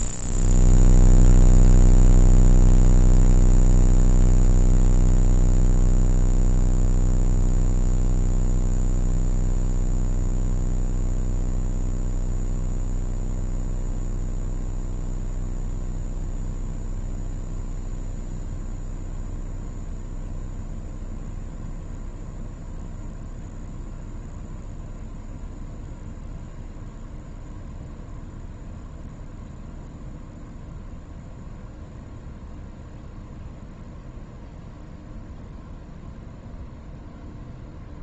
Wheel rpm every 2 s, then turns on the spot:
0, 0, 0, 0, 0, 0, 0, 0, 0, 0, 0, 0, 0, 0, 0, 0, 0, 0, 0.
none